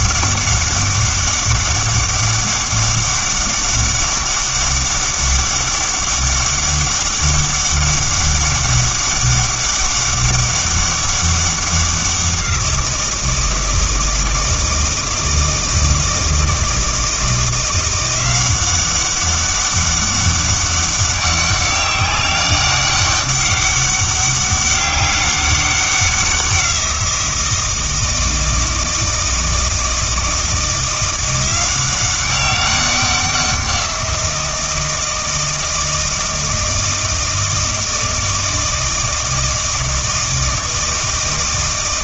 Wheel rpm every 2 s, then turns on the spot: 200, 200, 200, 200, 200, 200, 170, 160, 160, 190, 200, 200, 200, 180, 160, 170, 190, 170, 160, 160, 160.
none